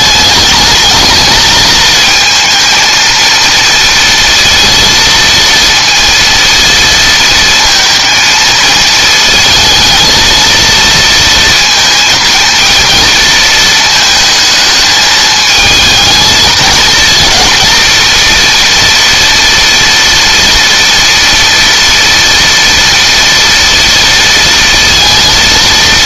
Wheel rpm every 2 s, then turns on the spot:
210, 230, 230, 230, 230, 230, 220, 220, 230, 240, 230, 230, 230.
none